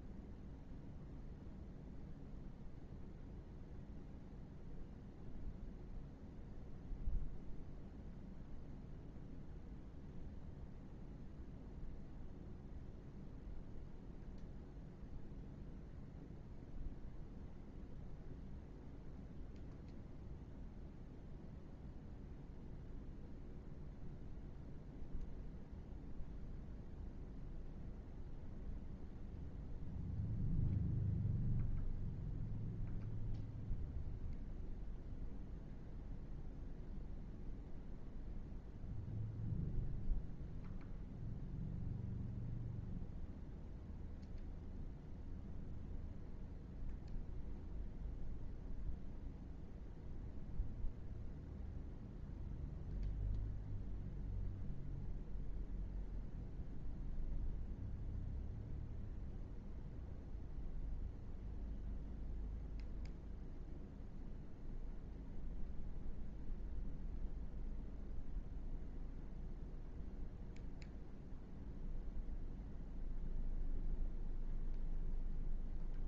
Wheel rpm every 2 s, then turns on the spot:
0, 0, 0, 0, 0, 0, 0, 0, 0, 0, 0, 0, 0, 0, 0, 0, 0, 0, 0, 0, 0, 0, 0, 0, 0, 0, 0, 0, 0, 0, 0, 0, 0, 0, 0, 0, 0, 0.
none